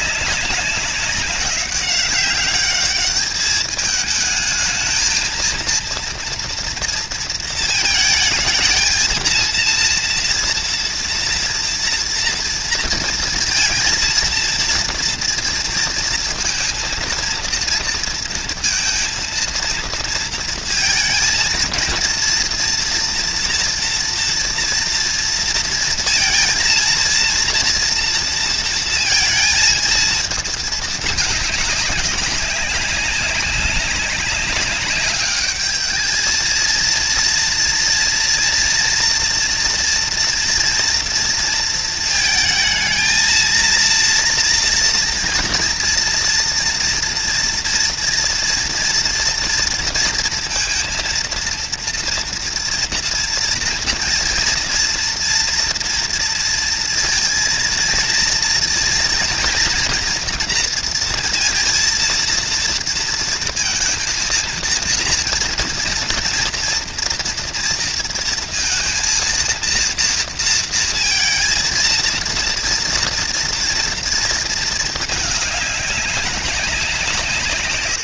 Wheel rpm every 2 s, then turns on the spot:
190, 200, 220, 230, 220, 230, 230, 230, 230, 230, 230, 230, 230, 230, 230, 210, 190, 190, 230, 230, 230, 220, 230, 230, 230, 230, 230, 230, 230, 230, 230, 230, 230, 230, 230, 230, 230, 220, 190.
none